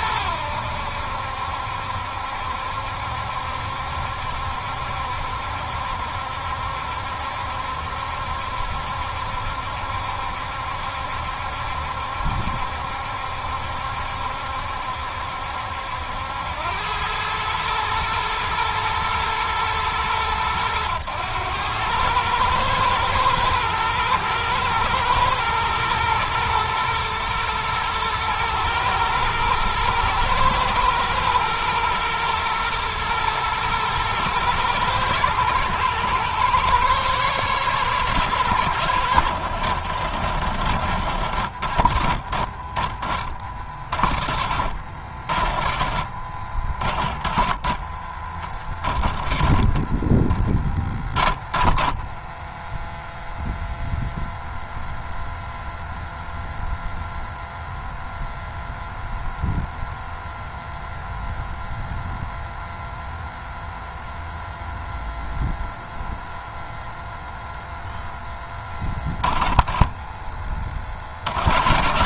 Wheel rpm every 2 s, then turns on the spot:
80, 70, 70, 70, 70, 70, 70, 70, 100, 110, 110, 110, 110, 110, 110, 120, 110, 110, 130, 100, 60, 30, 40, 40, 30, 20, 0, 0, 0, 0, 0, 0, 0, 0, 10, 40.
none